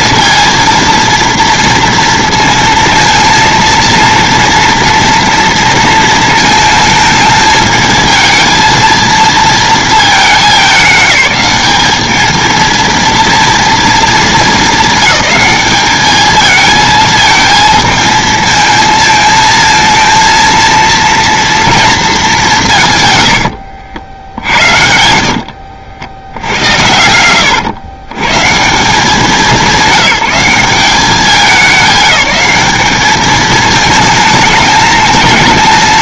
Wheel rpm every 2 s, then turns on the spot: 230, 230, 230, 220, 220, 210, 220, 220, 220, 220, 230, 170, 80, 90, 150, 190, 210, 220.
24-26